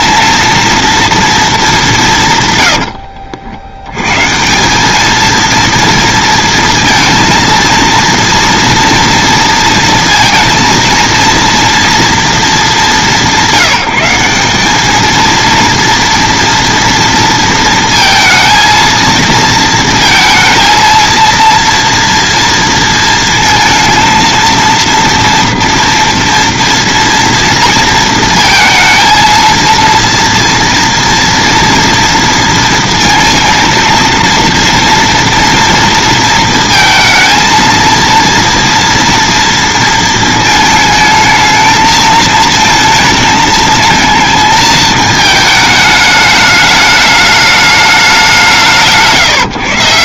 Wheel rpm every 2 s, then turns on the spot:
230, 120, 170, 230, 230, 230, 220, 200, 230, 230, 230, 230, 230, 230, 220, 230, 230, 230, 230, 230, 220, 220, 220, 210, 160.
none